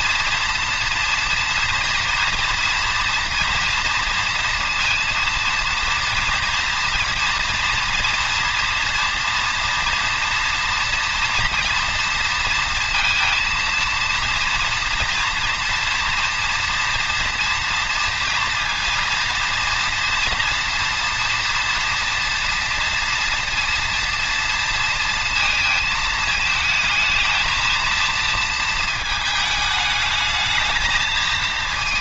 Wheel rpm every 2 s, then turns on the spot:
230, 230, 230, 230, 230, 230, 230, 230, 240, 230, 230, 230, 230, 220, 220, 220.
none